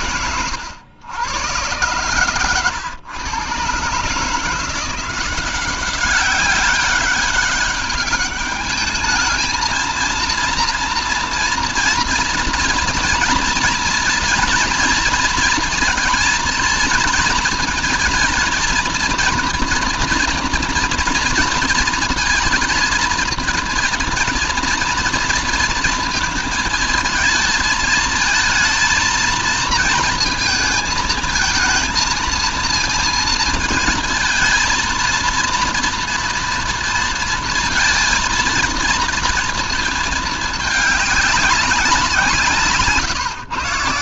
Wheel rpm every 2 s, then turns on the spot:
110, 130, 160, 190, 210, 230, 230, 230, 230, 230, 240, 230, 230, 230, 220, 230, 230, 220, 230, 230, 220, 160.
none